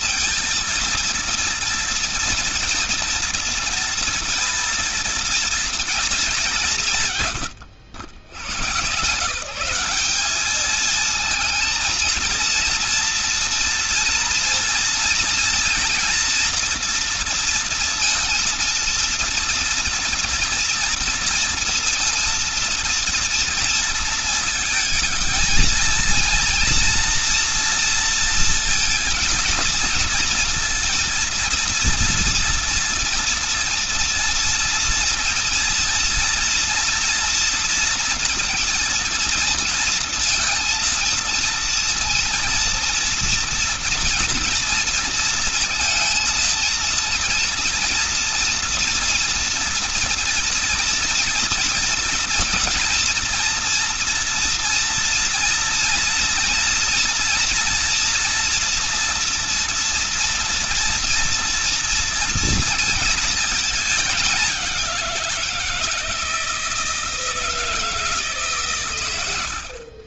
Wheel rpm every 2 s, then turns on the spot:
230, 230, 230, 170, 110, 220, 230, 230, 230, 230, 230, 230, 220, 230, 230, 230, 230, 230, 230, 230, 230, 230, 230, 230, 240, 230, 230, 230, 230, 240, 230, 230, 190, 160, 120.
none